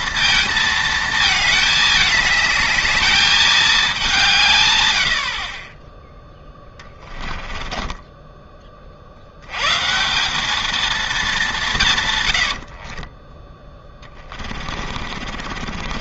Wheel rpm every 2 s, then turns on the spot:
220, 210, 130, 20, 20, 210, 70, 40.
6-8 12-16